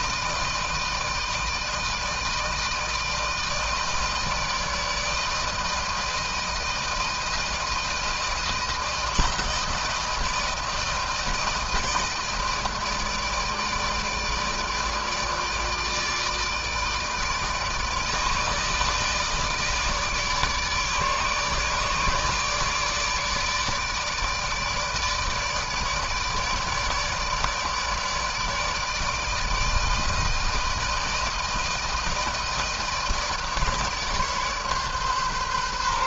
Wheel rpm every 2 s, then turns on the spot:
160, 160, 160, 160, 160, 160, 160, 150, 160, 160, 150, 150, 160, 160, 150, 160, 160, 140.
none